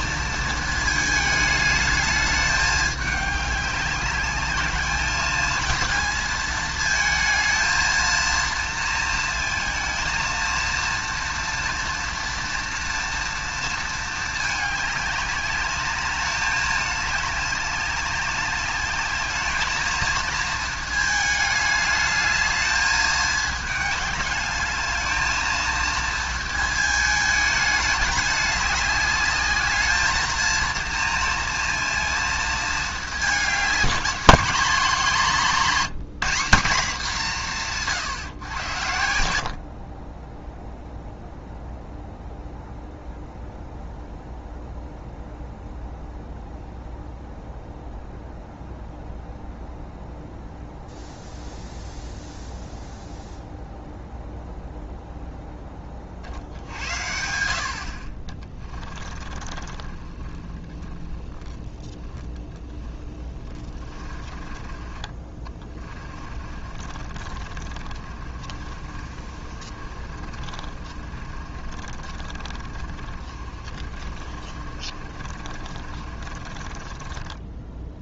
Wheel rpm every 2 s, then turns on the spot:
220, 210, 210, 220, 230, 230, 230, 210, 210, 200, 220, 210, 210, 220, 200, 230, 220, 220, 200, 90, 0, 0, 0, 0, 0, 0, 0, 0, 70, 30, 20, 30, 20, 50, 50, 50, 40, 50, 30.
58-78